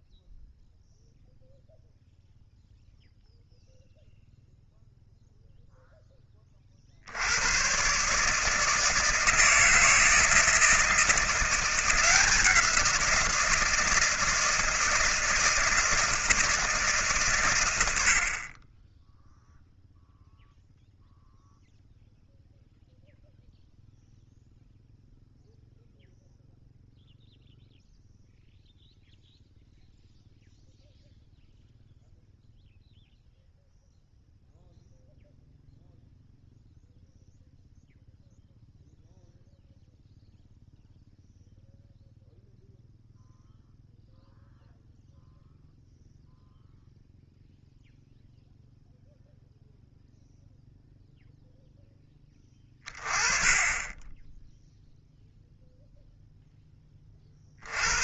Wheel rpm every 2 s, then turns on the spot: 0, 0, 0, 40, 160, 170, 170, 160, 150, 20, 0, 0, 0, 0, 0, 0, 0, 0, 0, 0, 0, 0, 0, 0, 0, 0, 20, 0, 10.
none